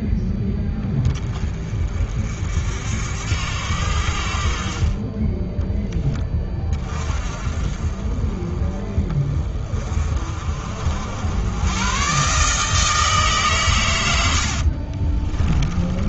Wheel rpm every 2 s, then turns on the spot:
20, 70, 40, 30, 30, 60, 150, 50.
14-16